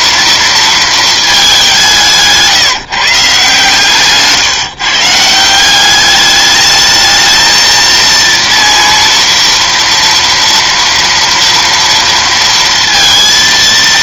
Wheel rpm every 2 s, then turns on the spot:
230, 170, 150, 210, 230, 230, 230.
none